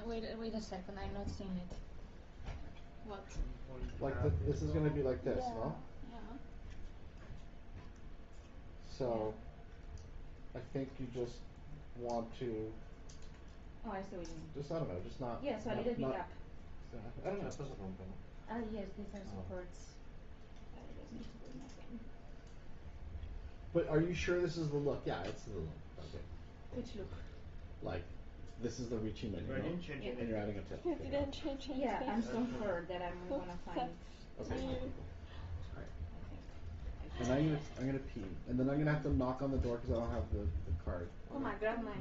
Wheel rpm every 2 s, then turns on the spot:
0, 0, 0, 0, 0, 0, 0, 0, 0, 0, 0, 0, 0, 0, 0, 0, 0, 0, 0, 0, 0.
none